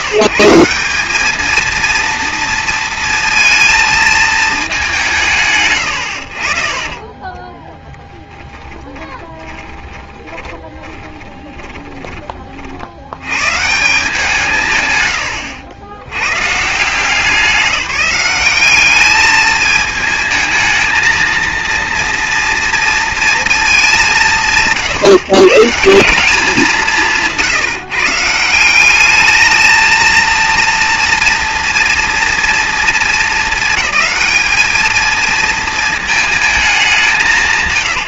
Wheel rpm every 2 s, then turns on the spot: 160, 230, 220, 60, 10, 20, 40, 150, 140, 200, 220, 230, 150, 180, 170, 230, 230, 220, 210.
8-12